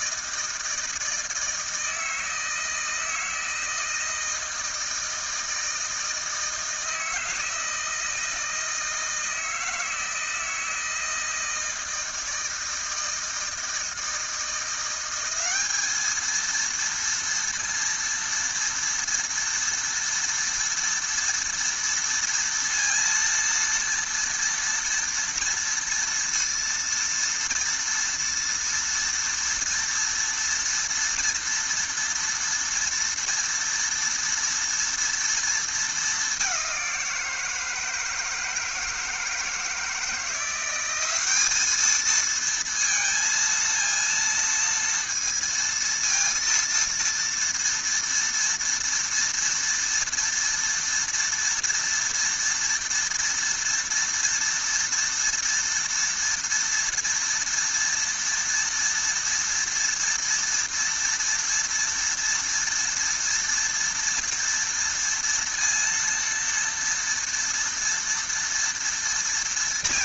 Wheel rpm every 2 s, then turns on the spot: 160, 160, 160, 160, 160, 160, 160, 190, 230, 230, 230, 230, 230, 230, 230, 240, 230, 230, 180, 160, 200, 230, 230, 230, 230, 240, 230, 230, 240, 230, 230, 230, 230, 230, 230.
none